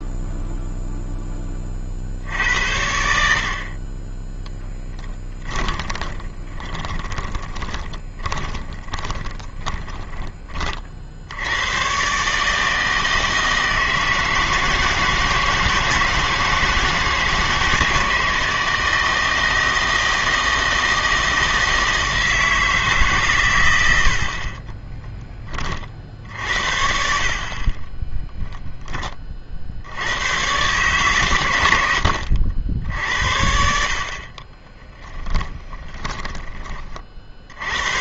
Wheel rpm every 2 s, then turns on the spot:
0, 80, 10, 20, 20, 40, 150, 160, 160, 160, 160, 160, 30, 70, 0, 120, 70, 30, 20.
4-10 34-36